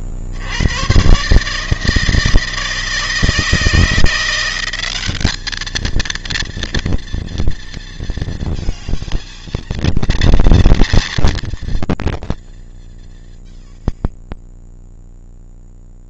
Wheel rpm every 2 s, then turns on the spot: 80, 160, 180, 230, 230, 230, 210, 20.
none